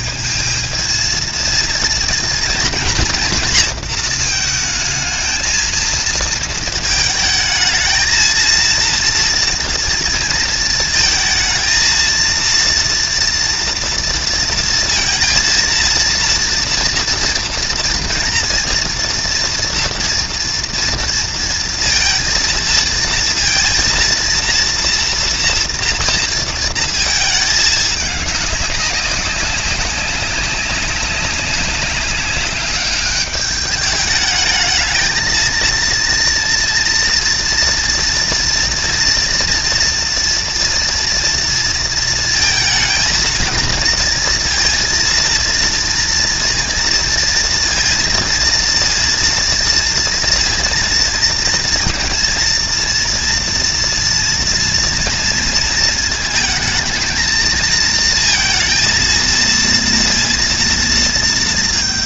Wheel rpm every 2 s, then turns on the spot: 220, 230, 220, 220, 230, 220, 230, 230, 230, 230, 230, 230, 230, 230, 200, 190, 210, 220, 230, 230, 230, 220, 230, 230, 230, 230, 230, 230, 220, 230, 230.
none